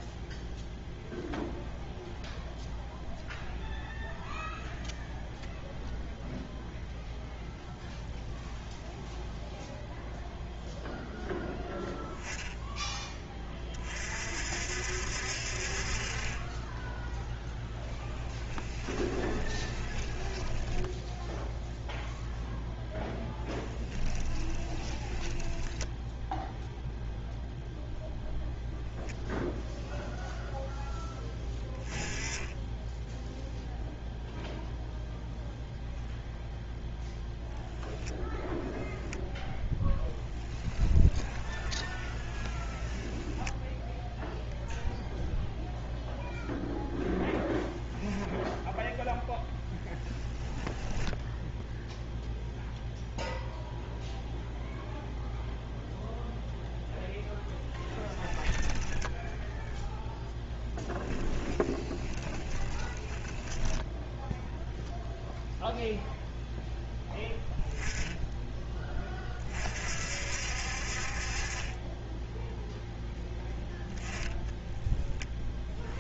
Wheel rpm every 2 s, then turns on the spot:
0, 0, 0, 0, 0, 0, 10, 60, 10, 20, 10, 0, 10, 0, 0, 10, 0, 0, 0, 0, 10, 20, 0, 0, 0, 10, 0, 0, 0, 20, 10, 10, 0, 10, 20, 40, 0, 10.
18-22 24-26 40-44 50-52 58-64